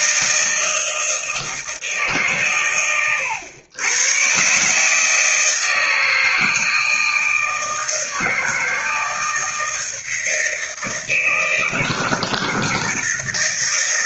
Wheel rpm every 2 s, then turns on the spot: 160, 110, 150, 160, 160, 160, 160.
none